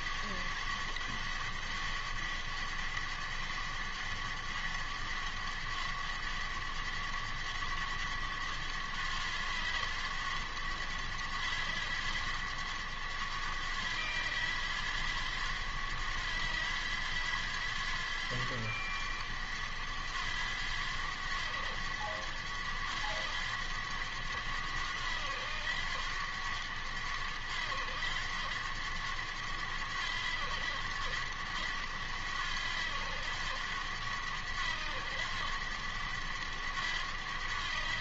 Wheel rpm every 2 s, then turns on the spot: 100, 100, 100, 100, 100, 100, 100, 90, 90, 100, 90, 100, 90, 90, 100, 90, 90, 90, 100.
none